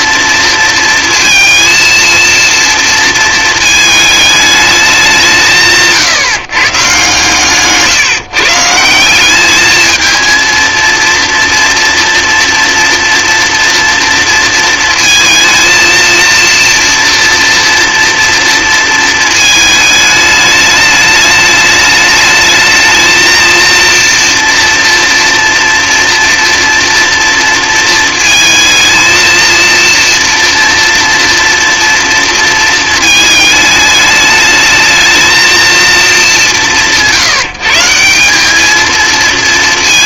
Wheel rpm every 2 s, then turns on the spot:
230, 230, 200, 130, 160, 230, 230, 230, 240, 230, 210, 220, 240, 240, 230, 230, 220, 220, 170, 210.
none